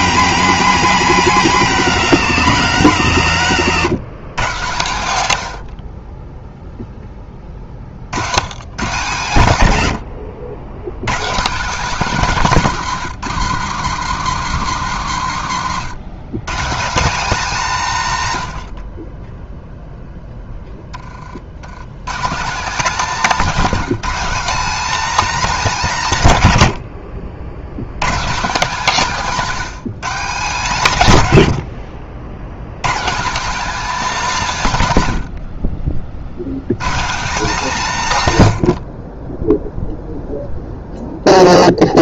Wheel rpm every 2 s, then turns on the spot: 240, 190, 130, 10, 150, 130, 200, 180, 200, 30, 10, 190, 250, 100, 190, 160, 150, 120, 150, 30, 0.
none